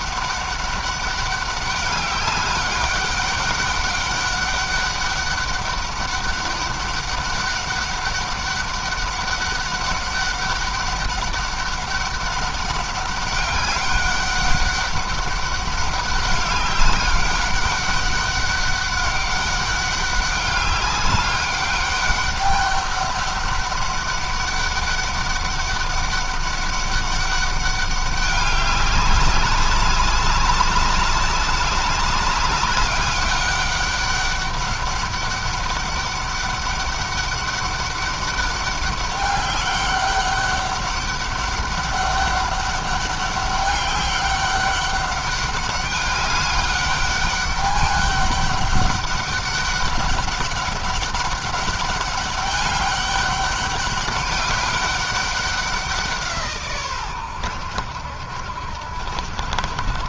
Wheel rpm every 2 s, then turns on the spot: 200, 200, 200, 200, 200, 190, 200, 200, 200, 200, 190, 200, 200, 200, 200, 200, 200, 200, 200, 200, 200, 200, 200, 200, 200, 200, 200, 200, 140, 70.
none